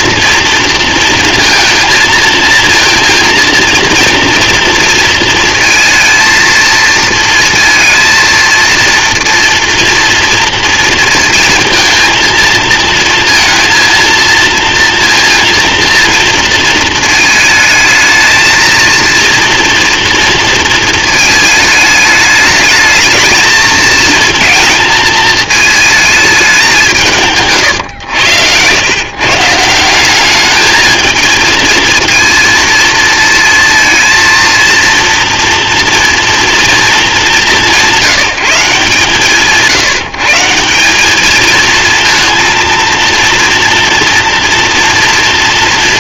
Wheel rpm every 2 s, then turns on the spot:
230, 230, 230, 230, 230, 230, 230, 230, 230, 220, 230, 220, 220, 190, 110, 220, 230, 230, 230, 140, 160, 230, 230.
none